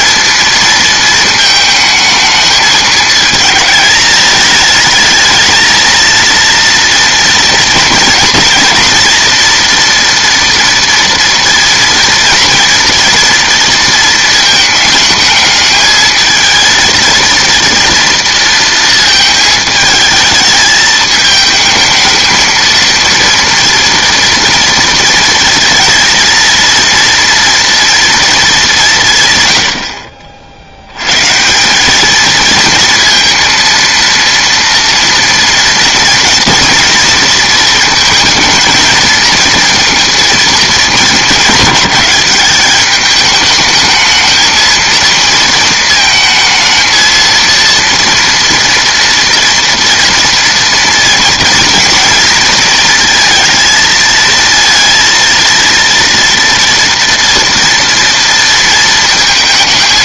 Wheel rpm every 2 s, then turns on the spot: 230, 210, 210, 230, 230, 230, 230, 220, 220, 230, 220, 230, 230, 230, 200, 70, 230, 230, 230, 220, 220, 200, 220, 220, 230, 230, 230, 230, 230, 230.
none